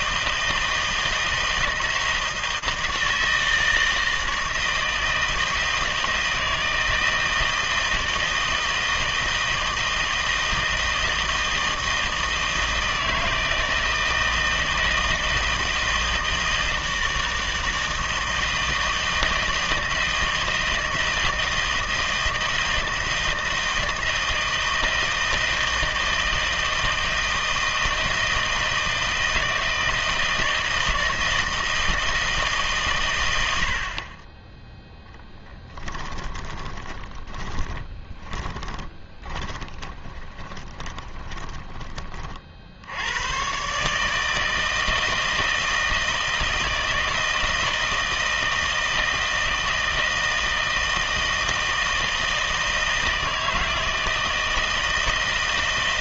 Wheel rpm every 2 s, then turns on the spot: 160, 160, 160, 160, 160, 160, 160, 160, 160, 160, 160, 160, 160, 160, 160, 160, 90, 10, 20, 20, 20, 100, 160, 160, 160, 160, 160, 160.
34-42